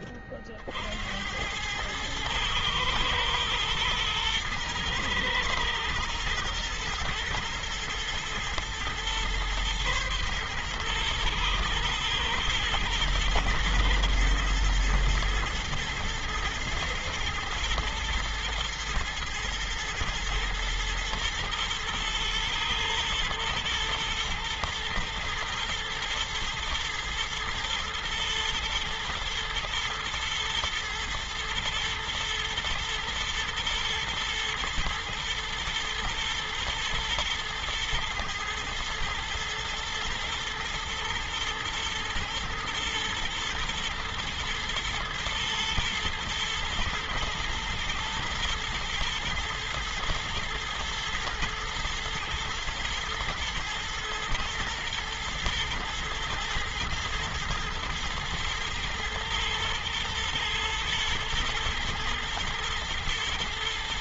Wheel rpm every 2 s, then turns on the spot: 30, 110, 110, 110, 120, 120, 110, 110, 120, 110, 110, 110, 120, 120, 110, 120, 120, 110, 110, 110, 120, 110, 110, 110, 120, 110, 110, 110, 110, 110, 120, 120.
none